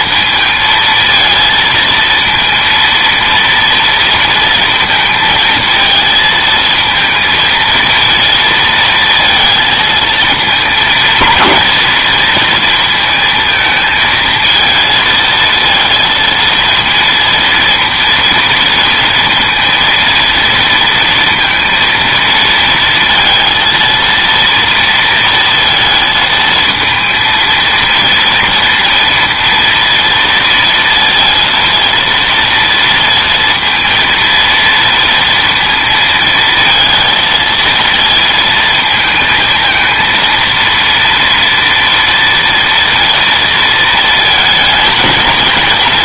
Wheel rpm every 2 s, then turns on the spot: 220, 230, 230, 220, 230, 220, 220, 220, 230, 230, 230, 230, 230, 220, 230, 230, 230, 230, 230, 230, 230, 230, 220.
none